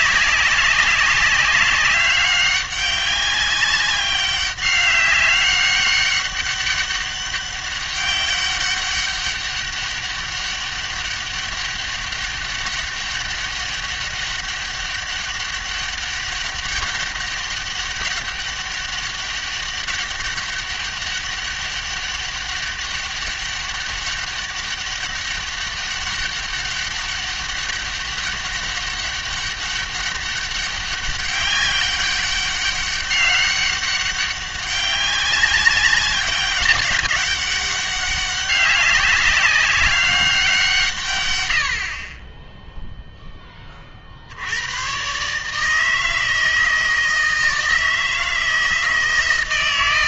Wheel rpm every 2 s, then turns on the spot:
200, 200, 200, 200, 200, 200, 200, 200, 200, 200, 200, 200, 200, 200, 200, 200, 200, 200, 200, 200, 150, 0, 110, 160, 160.
none